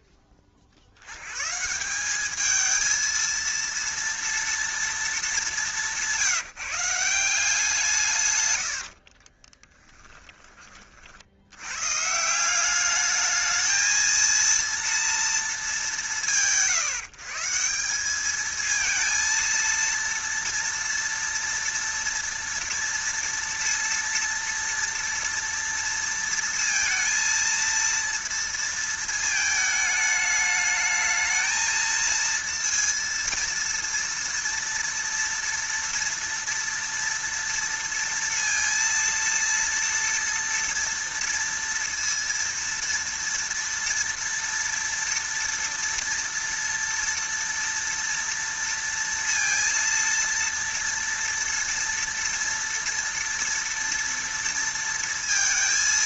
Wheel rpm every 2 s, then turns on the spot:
70, 230, 220, 170, 50, 60, 210, 240, 150, 220, 230, 230, 230, 230, 220, 220, 230, 230, 230, 230, 230, 230, 230, 230, 230, 230, 230, 230.
8-10